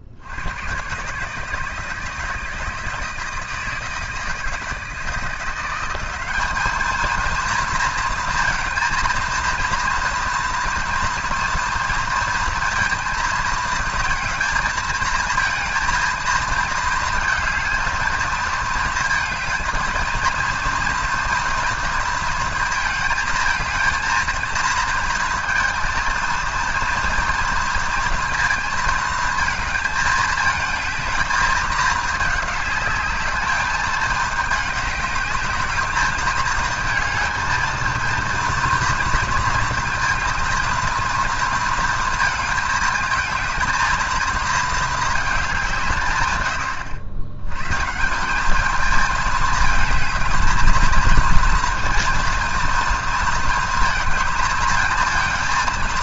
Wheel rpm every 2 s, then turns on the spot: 120, 160, 160, 210, 230, 230, 230, 220, 230, 220, 230, 220, 220, 230, 230, 220, 210, 210, 220, 230, 230, 220, 220, 110, 210, 220, 230, 230.
none